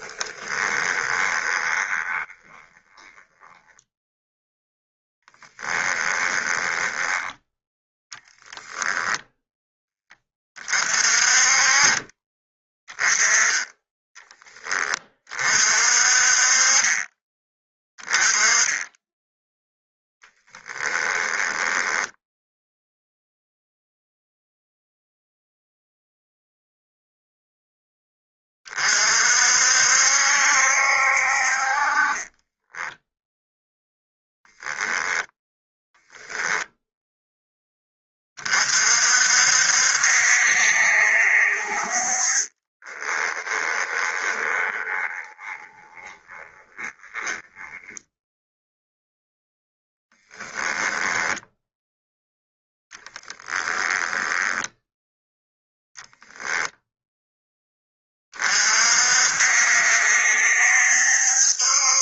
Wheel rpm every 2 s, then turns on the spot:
20, 20, 0, 10, 10, 30, 20, 30, 30, 10, 20, 0, 0, 0, 40, 60, 10, 0, 0, 50, 60, 20, 20, 20, 0, 10, 10, 10, 0, 50, 70.
0-4 6-10 20-22 32-34 42-48 50-54